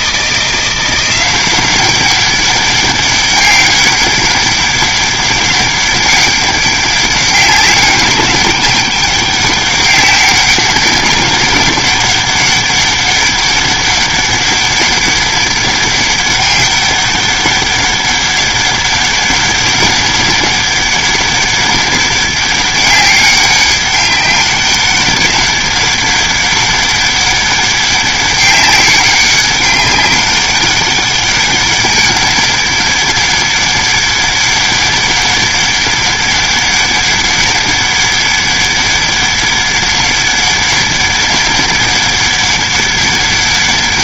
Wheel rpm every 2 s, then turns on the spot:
180, 200, 200, 200, 200, 190, 200, 200, 200, 200, 200, 200, 200, 200, 200, 200, 200, 200, 200, 200, 200, 200.
none